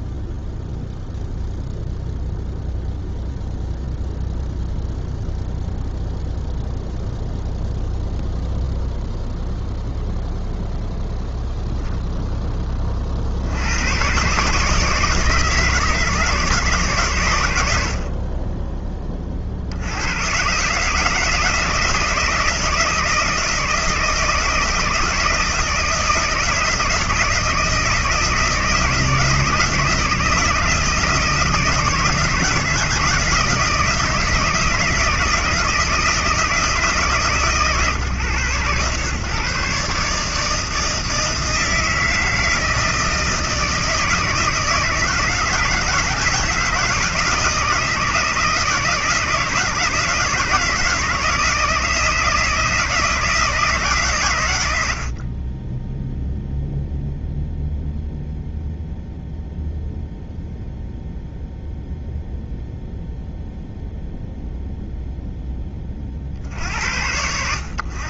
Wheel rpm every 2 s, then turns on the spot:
0, 0, 0, 0, 0, 0, 120, 150, 60, 100, 160, 170, 170, 160, 160, 170, 160, 160, 130, 150, 160, 160, 160, 170, 160, 160, 140, 10, 0, 0, 0, 0, 10, 100.
none